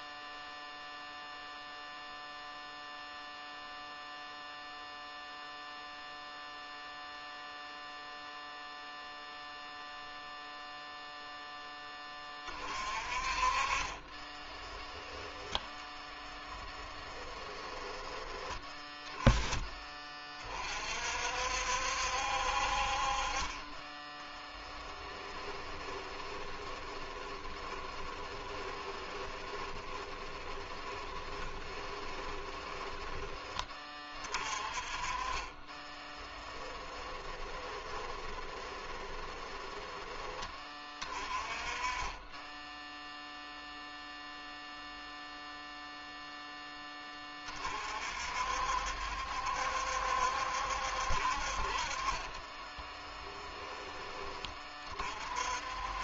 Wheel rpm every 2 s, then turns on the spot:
0, 0, 0, 0, 0, 0, 30, 10, 20, 10, 40, 50, 20, 20, 20, 20, 10, 30, 10, 20, 20, 10, 0, 10, 60, 60, 10, 40.
12-14 16-18 24-34 36-40 52-54